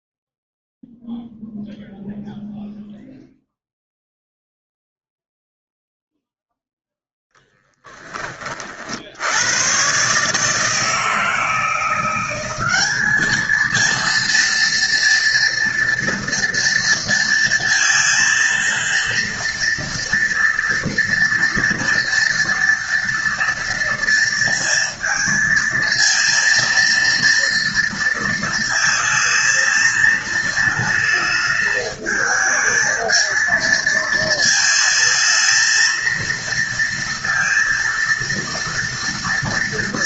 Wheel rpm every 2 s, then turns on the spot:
0, 0, 0, 0, 30, 150, 190, 230, 230, 230, 240, 230, 230, 230, 230, 230, 220, 220, 230, 230.
none